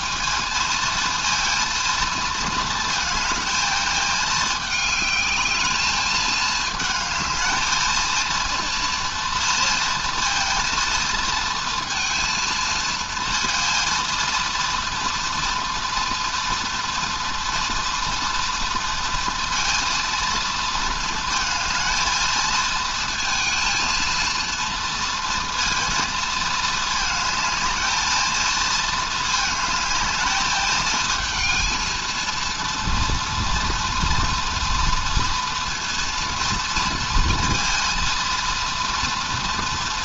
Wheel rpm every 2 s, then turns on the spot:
220, 230, 210, 220, 230, 230, 230, 230, 230, 230, 230, 220, 230, 220, 230, 220, 230, 230, 230, 230.
none